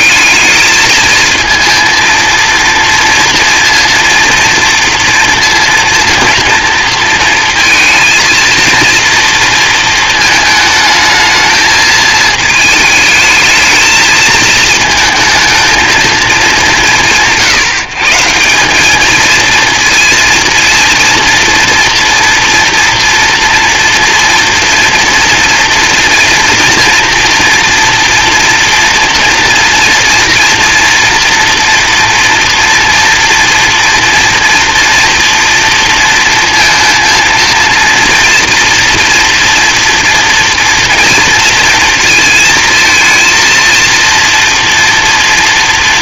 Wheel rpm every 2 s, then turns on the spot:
200, 230, 230, 230, 230, 220, 210, 220, 220, 150, 230, 230, 230, 230, 230, 230, 240, 230, 230, 230, 240, 230, 230.
none